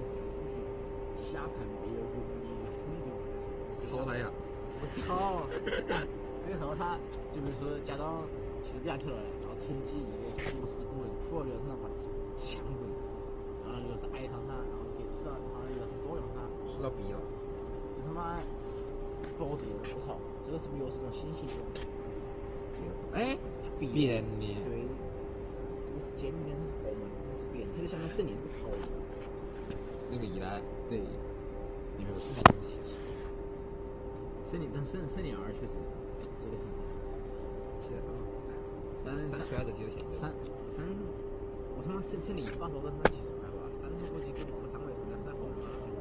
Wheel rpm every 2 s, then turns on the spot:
0, 0, 0, 0, 0, 0, 0, 0, 0, 0, 0, 0, 0, 0, 0, 0, 0, 0, 0, 0, 0, 0, 0.
none